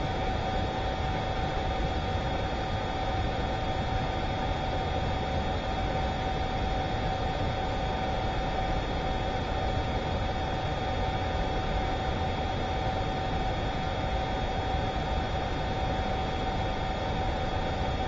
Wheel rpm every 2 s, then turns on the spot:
0, 0, 0, 0, 0, 0, 0, 0, 0.
none